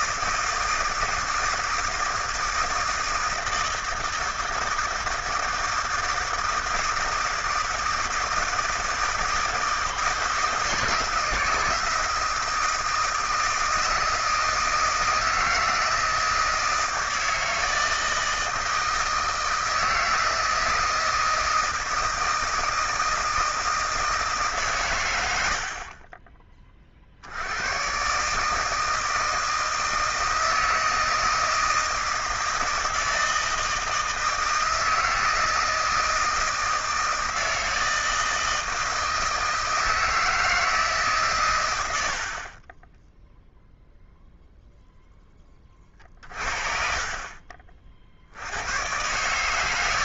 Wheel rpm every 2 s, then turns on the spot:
160, 160, 160, 160, 160, 160, 160, 160, 160, 160, 160, 160, 140, 30, 150, 160, 160, 160, 160, 160, 160, 20, 0, 40, 70.
42-44 46-48